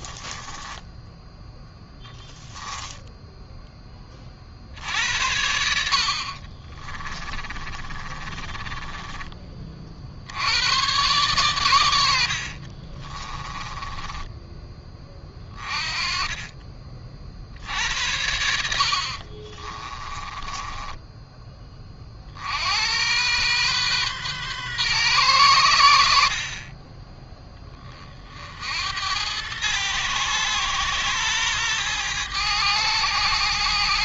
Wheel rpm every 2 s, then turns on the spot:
10, 10, 60, 20, 30, 110, 40, 20, 30, 60, 10, 80, 120, 20, 90, 120, 110.
2-4 6-10 12-14 18-22